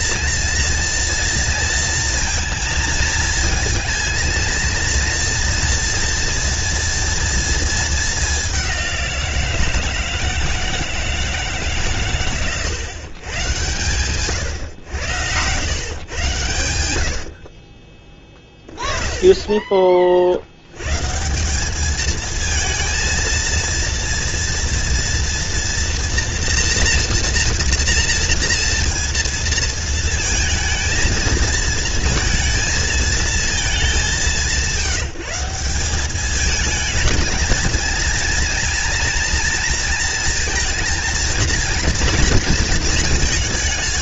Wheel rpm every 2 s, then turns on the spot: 230, 230, 230, 230, 190, 160, 130, 110, 90, 20, 100, 230, 240, 230, 230, 230, 230, 180, 220, 230, 230, 220.
none